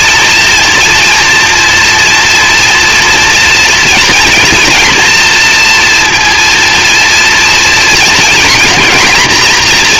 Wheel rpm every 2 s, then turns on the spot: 230, 230, 230, 230, 240.
none